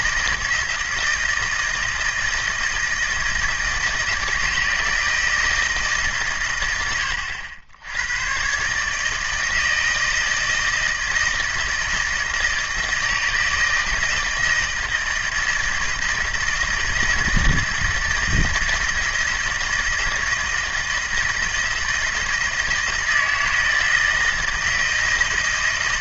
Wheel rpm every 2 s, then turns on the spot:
160, 160, 160, 100, 140, 160, 160, 160, 160, 160, 160, 160, 160.
none